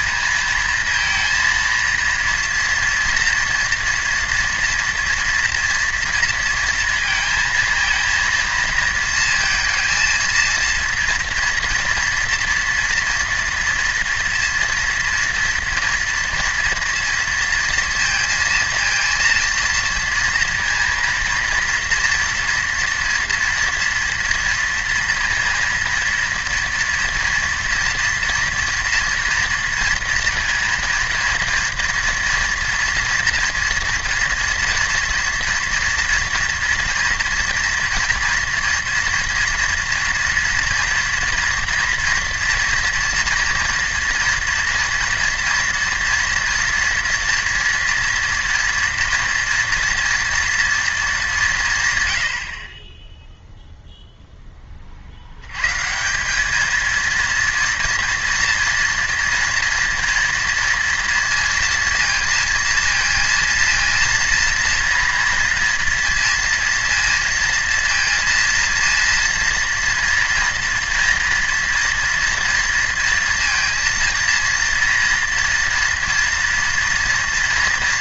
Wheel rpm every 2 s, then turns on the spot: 230, 240, 240, 230, 230, 230, 240, 230, 230, 230, 230, 230, 230, 230, 230, 230, 230, 230, 230, 230, 230, 230, 230, 230, 240, 230, 60, 20, 210, 230, 230, 230, 230, 230, 230, 230, 230, 230, 230.
none